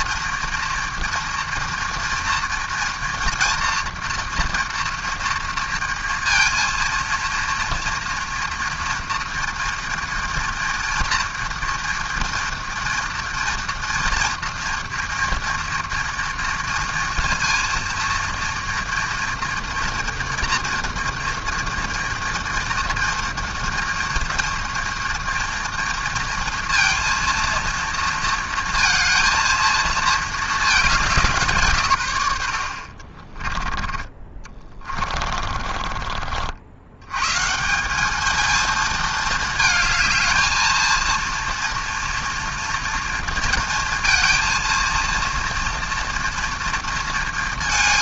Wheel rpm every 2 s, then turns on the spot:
230, 230, 230, 230, 230, 230, 230, 230, 230, 230, 230, 230, 230, 230, 230, 200, 60, 40, 100, 220, 230, 230, 230, 230.
34-36